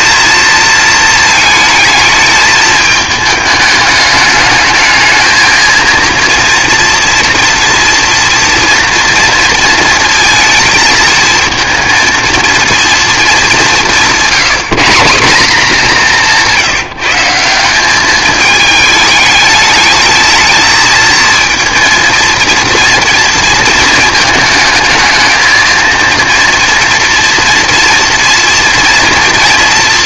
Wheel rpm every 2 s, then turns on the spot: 230, 210, 210, 230, 230, 220, 230, 180, 170, 210, 230, 230, 220, 230, 230.
none